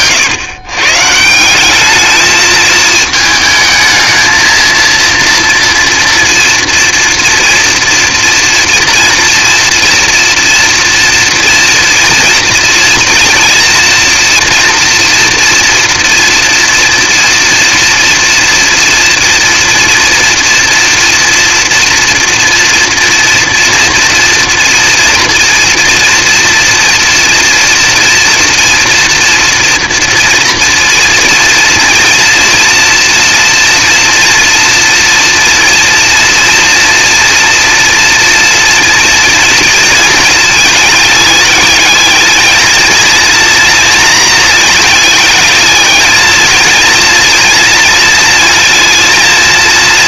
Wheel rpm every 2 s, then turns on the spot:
120, 220, 230, 230, 230, 230, 230, 230, 240, 230, 230, 230, 230, 230, 230, 230, 230, 230, 230, 240, 220, 220, 220, 230, 230.
none